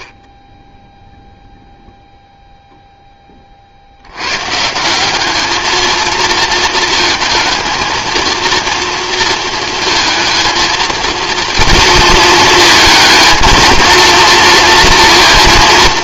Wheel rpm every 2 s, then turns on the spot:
0, 10, 180, 220, 230, 230, 220, 230.
none